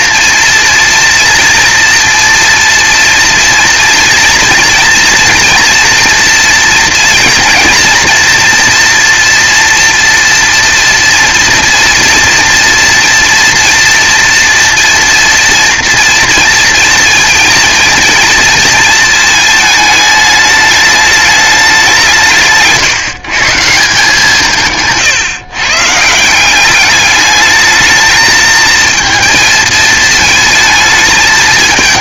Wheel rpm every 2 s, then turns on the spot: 230, 230, 240, 230, 240, 240, 230, 240, 230, 220, 210, 150, 160, 190, 220, 220.
22-24